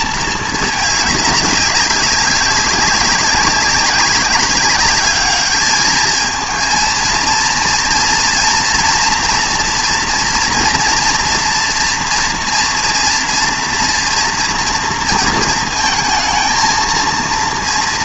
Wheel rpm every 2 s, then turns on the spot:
210, 200, 200, 230, 230, 230, 230, 230, 220.
none